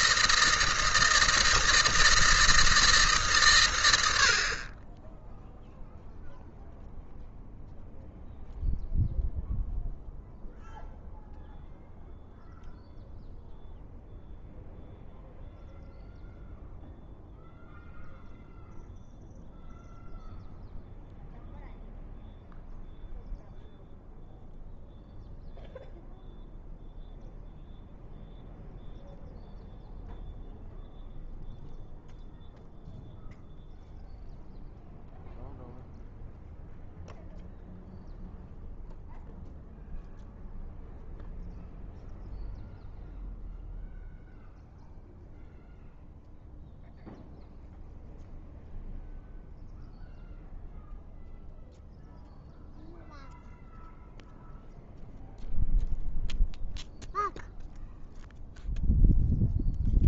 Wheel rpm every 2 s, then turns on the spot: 160, 160, 30, 0, 0, 0, 0, 0, 0, 0, 0, 0, 0, 0, 0, 0, 0, 0, 0, 0, 0, 0, 0, 0, 0, 0, 0, 0, 0, 0.
none